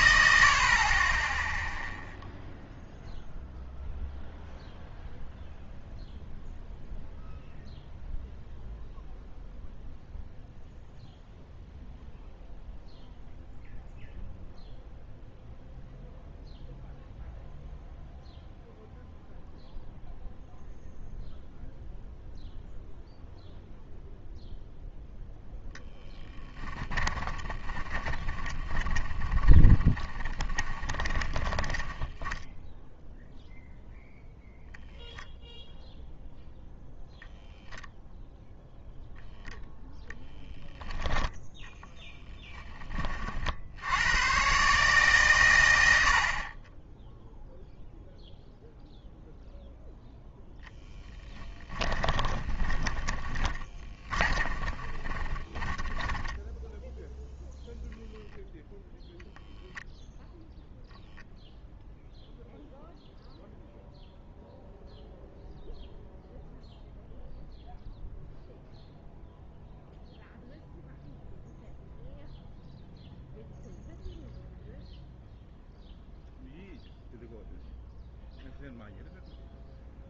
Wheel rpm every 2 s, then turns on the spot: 60, 0, 0, 0, 0, 0, 0, 0, 0, 0, 0, 0, 0, 10, 20, 20, 0, 0, 0, 0, 0, 10, 120, 40, 0, 10, 20, 20, 10, 0, 0, 0, 0, 0, 0, 0, 0, 0, 0, 0.
28-32 46-48 52-58